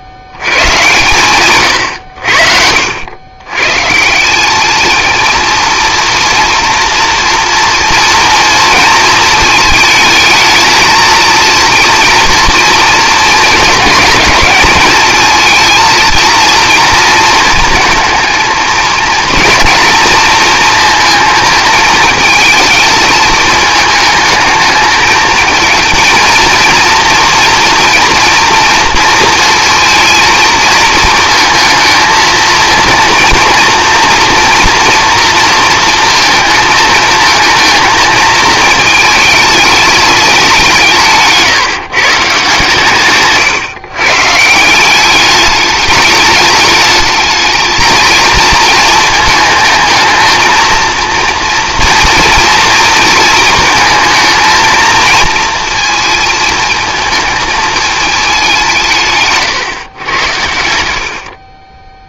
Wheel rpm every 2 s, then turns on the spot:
120, 90, 220, 230, 230, 230, 230, 210, 230, 220, 220, 220, 210, 230, 230, 230, 230, 230, 220, 220, 170, 140, 180, 220, 220, 230, 230, 230, 220, 170, 70.
none